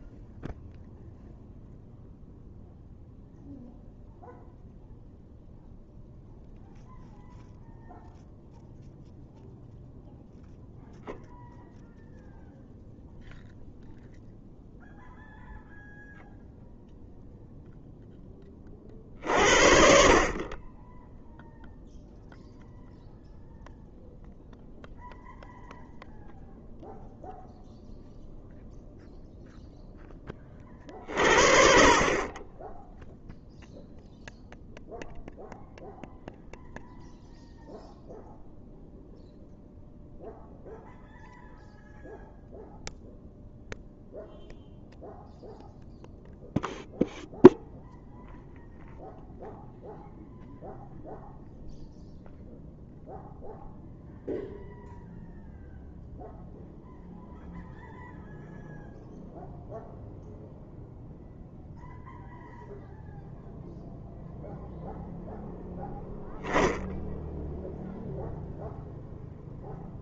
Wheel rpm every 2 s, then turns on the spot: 0, 0, 0, 0, 0, 0, 0, 0, 0, 40, 10, 0, 0, 0, 0, 40, 0, 0, 0, 0, 0, 0, 0, 0, 0, 0, 0, 0, 0, 0, 0, 0, 0, 10, 0.
none